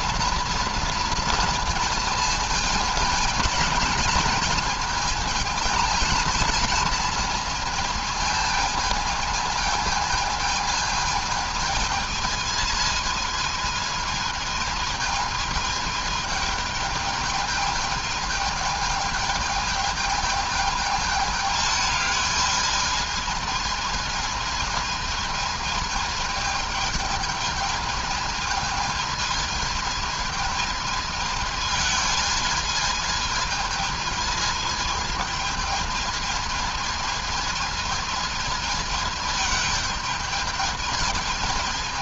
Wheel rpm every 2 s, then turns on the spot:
230, 230, 220, 220, 220, 220, 220, 220, 220, 220, 220, 210, 220, 220, 220, 220, 220, 220, 220, 220, 220.
none